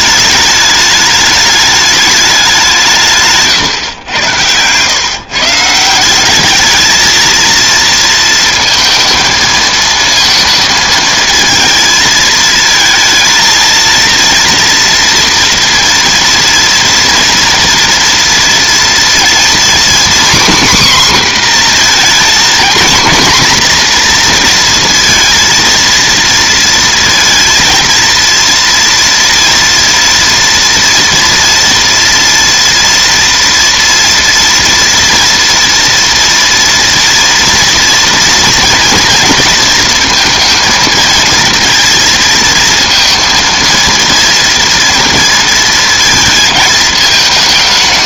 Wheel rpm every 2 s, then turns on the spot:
210, 170, 110, 220, 230, 230, 220, 230, 230, 230, 260, 240, 230, 230, 230, 230, 230, 230, 230, 230, 220, 220, 230, 220.
none